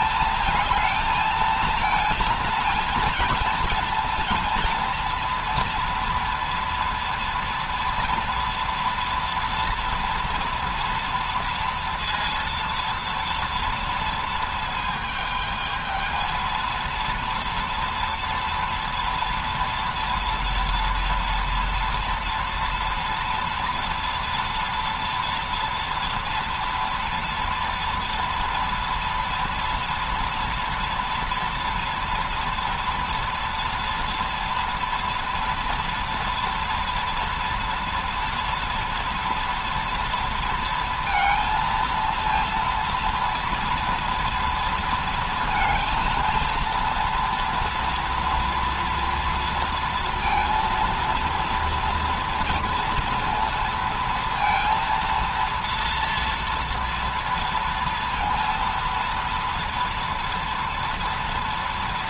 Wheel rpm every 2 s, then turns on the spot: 220, 230, 230, 230, 230, 230, 230, 220, 230, 230, 230, 230, 230, 240, 240, 230, 230, 240, 230, 230, 230, 230, 230, 230, 230, 230, 230, 230, 230, 230, 230.
none